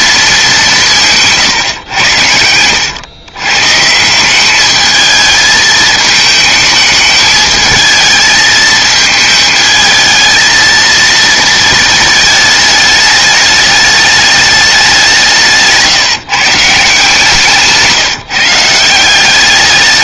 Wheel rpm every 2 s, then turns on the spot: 190, 110, 200, 220, 220, 220, 220, 200, 150, 160.
none